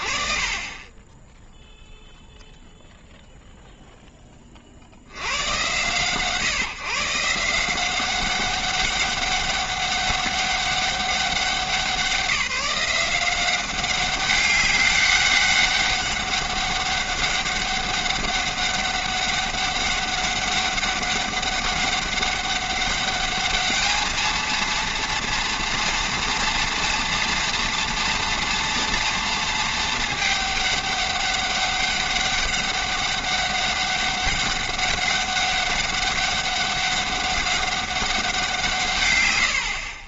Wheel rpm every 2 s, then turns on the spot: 20, 0, 30, 150, 190, 200, 180, 200, 200, 200, 200, 200, 220, 230, 230, 210, 200, 200, 200, 160.
none